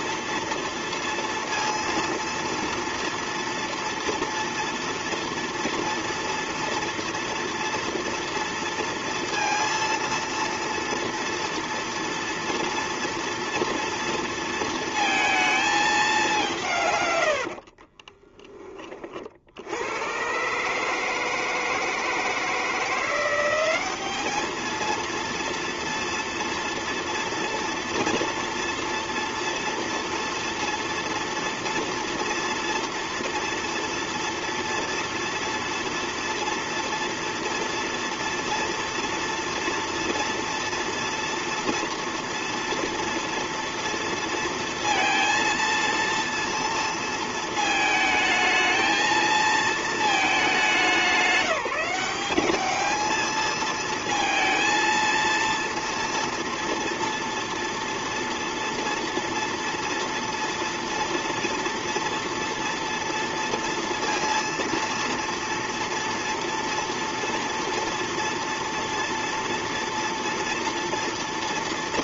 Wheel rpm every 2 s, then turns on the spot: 230, 230, 230, 230, 230, 230, 230, 230, 130, 40, 150, 170, 220, 230, 230, 230, 230, 230, 230, 230, 230, 230, 230, 230, 220, 190, 220, 230, 230, 230, 230, 230, 230, 230, 230, 240.
16-18